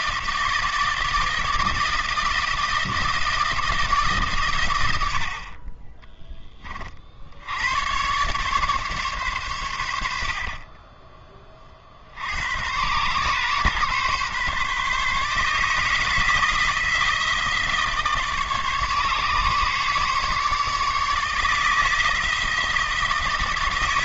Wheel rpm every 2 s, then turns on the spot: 160, 160, 100, 30, 140, 20, 110, 140, 170, 150, 150, 160.
none